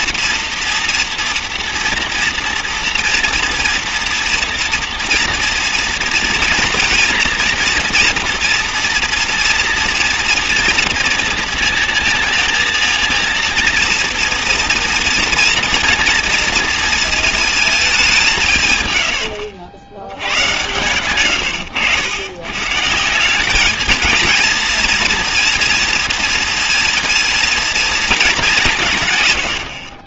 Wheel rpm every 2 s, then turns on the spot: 230, 240, 230, 230, 230, 230, 230, 230, 230, 140, 110, 140, 230, 220, 190.
20-22